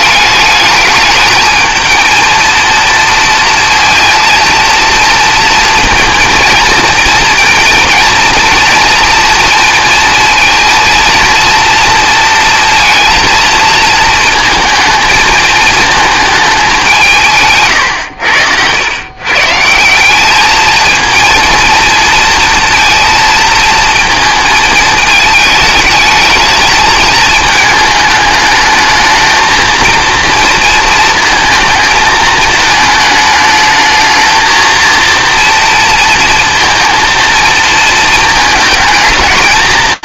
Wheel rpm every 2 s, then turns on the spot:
210, 230, 230, 230, 230, 230, 230, 220, 190, 110, 230, 230, 220, 220, 220, 230, 220, 230, 230, 220.
none